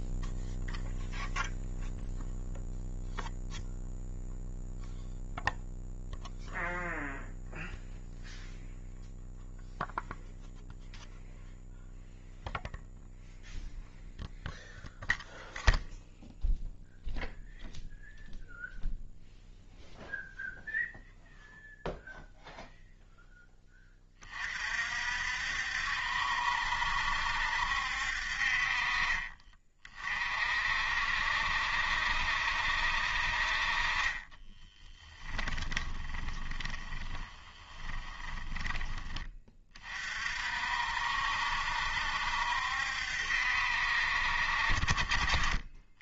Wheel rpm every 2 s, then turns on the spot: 0, 0, 0, 0, 0, 0, 0, 0, 0, 0, 0, 0, 50, 70, 40, 60, 60, 20, 30, 20, 60, 70, 50.
34-38